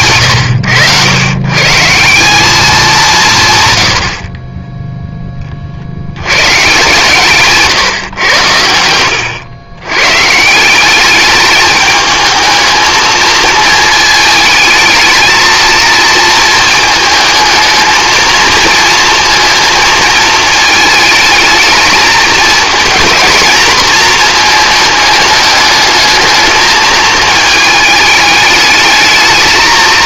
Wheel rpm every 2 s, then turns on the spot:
100, 200, 20, 130, 90, 180, 220, 220, 230, 230, 220, 230, 220, 220, 220.
8-10